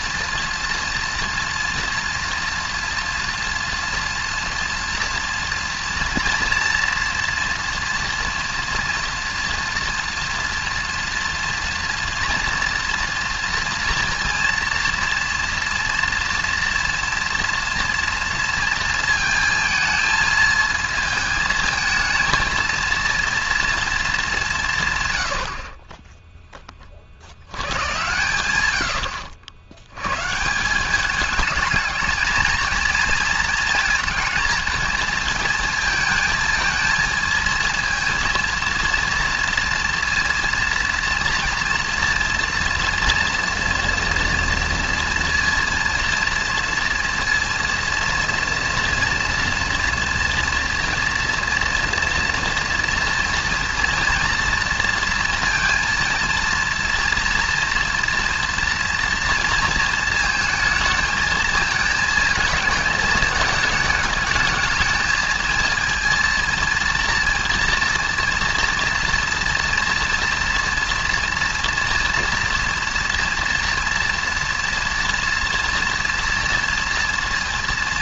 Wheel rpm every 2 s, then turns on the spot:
230, 230, 230, 240, 230, 230, 230, 230, 230, 230, 220, 230, 150, 20, 110, 180, 220, 230, 220, 230, 230, 230, 230, 230, 230, 230, 240, 230, 230, 230, 220, 220, 220, 230, 230, 230, 230, 230, 230.
none